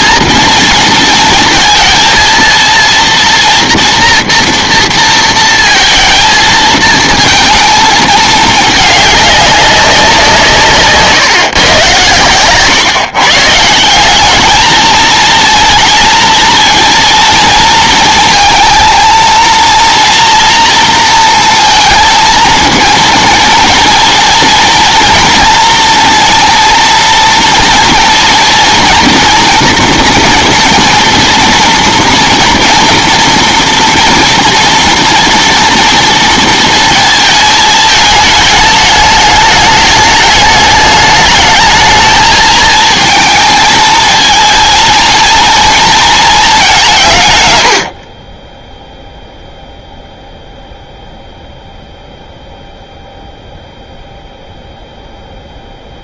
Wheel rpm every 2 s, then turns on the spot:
220, 230, 230, 220, 210, 150, 140, 220, 230, 230, 230, 230, 230, 230, 230, 230, 230, 230, 230, 210, 210, 220, 230, 180, 0, 0, 0, 0.
none